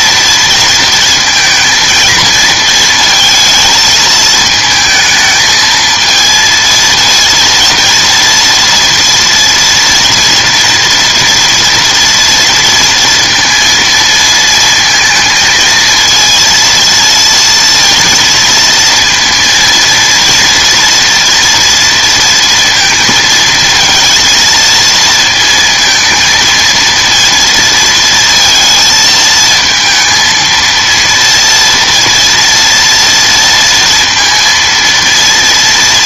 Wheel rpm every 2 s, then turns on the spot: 230, 220, 220, 230, 230, 230, 230, 230, 230, 230, 230, 230, 230, 230, 230, 230, 230, 230.
none